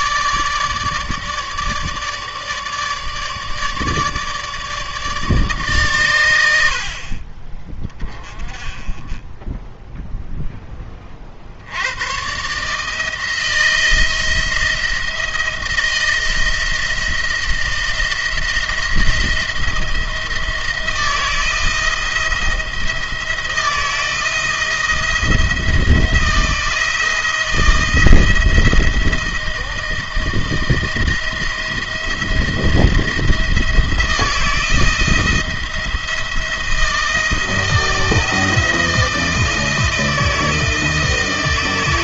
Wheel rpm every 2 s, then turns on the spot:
150, 150, 150, 60, 20, 20, 150, 160, 170, 170, 170, 160, 170, 170, 170, 170, 170, 170, 170, 160, 170.
none